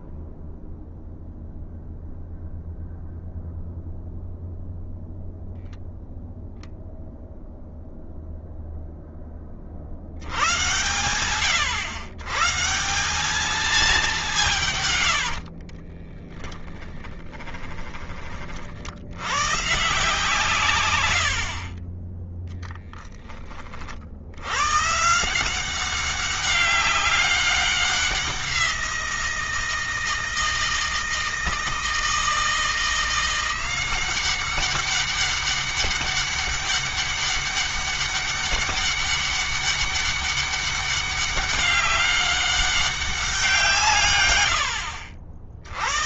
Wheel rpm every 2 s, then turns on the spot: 0, 0, 0, 0, 0, 100, 180, 110, 10, 80, 120, 0, 140, 190, 170, 160, 170, 200, 200, 200, 200, 190, 80.
14-18